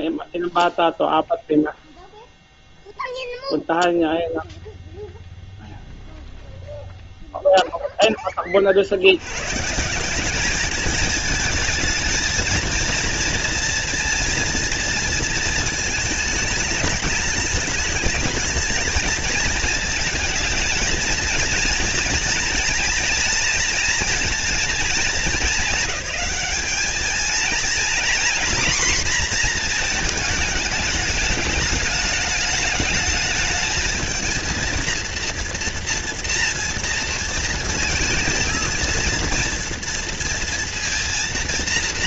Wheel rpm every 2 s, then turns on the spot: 0, 0, 0, 0, 60, 210, 230, 230, 210, 220, 230, 230, 230, 220, 240, 210, 220, 230, 230, 230, 230.
none